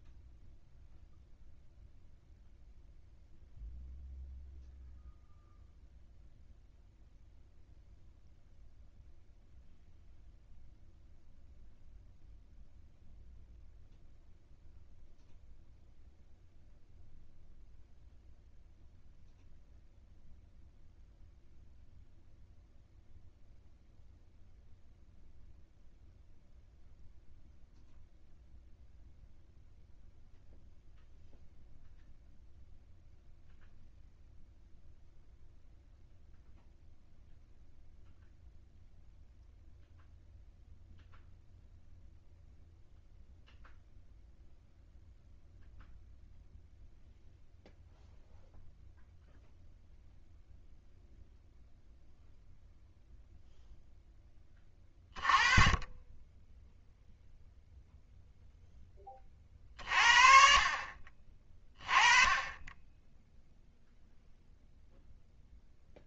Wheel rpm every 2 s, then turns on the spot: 0, 0, 0, 0, 0, 0, 0, 0, 0, 0, 0, 0, 0, 0, 0, 0, 0, 0, 0, 0, 0, 0, 0, 0, 0, 0, 0, 20, 10, 0, 40, 20, 0.
none